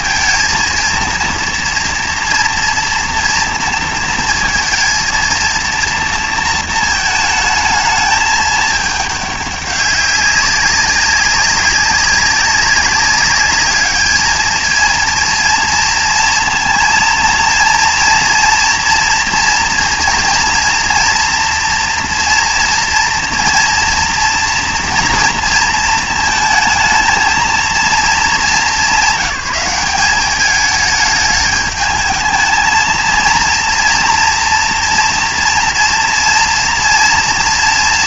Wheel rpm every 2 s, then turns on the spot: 230, 240, 230, 230, 210, 190, 200, 220, 230, 230, 230, 230, 230, 220, 180, 210, 220, 230, 230.
none